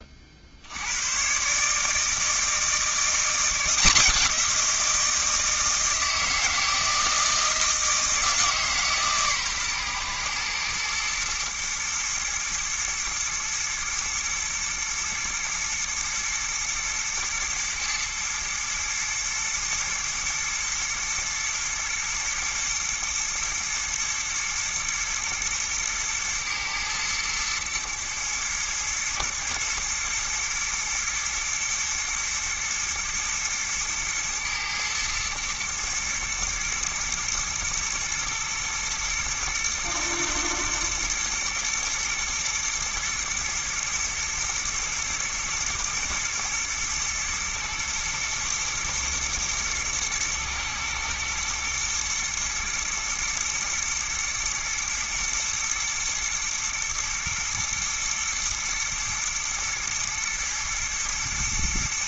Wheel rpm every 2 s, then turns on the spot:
80, 170, 170, 160, 150, 120, 120, 120, 120, 110, 120, 110, 120, 120, 110, 120, 110, 110, 110, 120, 110, 120, 120, 110, 110, 110, 110, 110, 120, 120, 120.
none